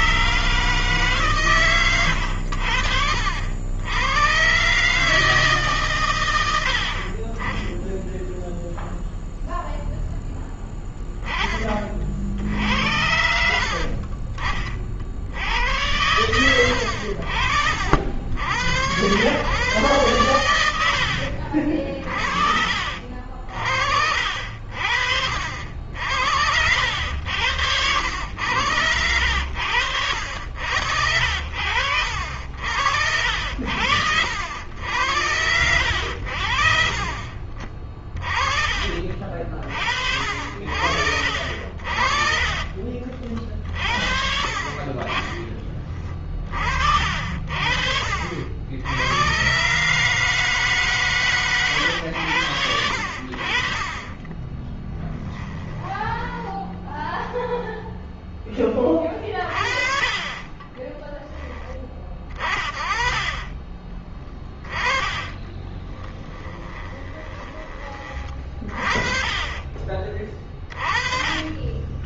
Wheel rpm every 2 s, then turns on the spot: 140, 70, 140, 60, 0, 10, 70, 50, 100, 90, 80, 50, 60, 80, 90, 70, 70, 80, 60, 40, 60, 50, 40, 50, 90, 150, 80, 10, 10, 20, 20, 20, 10, 20, 40, 30.
54-56 60-62 64-68 70-72